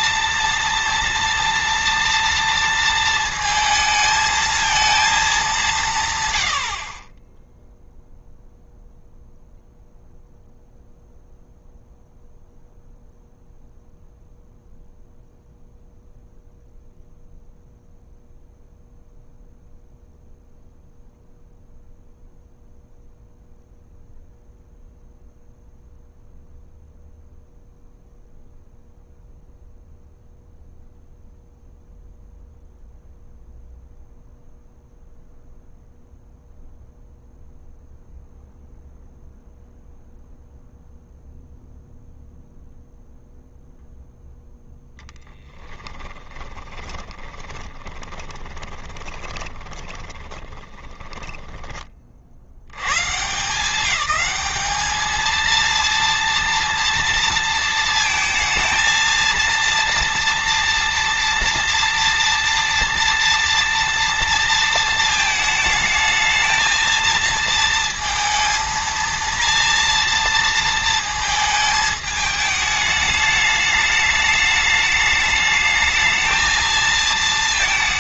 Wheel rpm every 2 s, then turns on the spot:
230, 230, 220, 50, 0, 0, 0, 0, 0, 0, 0, 0, 0, 0, 0, 0, 0, 0, 0, 0, 0, 0, 0, 20, 20, 20, 100, 220, 230, 230, 230, 230, 230, 220, 230, 230, 210, 210, 220.
46-52